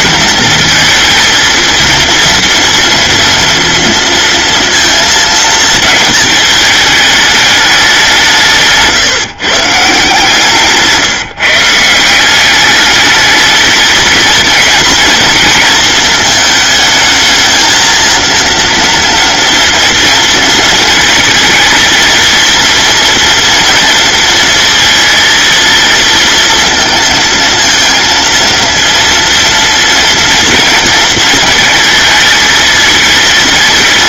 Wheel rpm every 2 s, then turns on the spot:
230, 230, 220, 210, 150, 150, 210, 230, 220, 230, 230, 240, 230, 230, 230, 220, 220.
none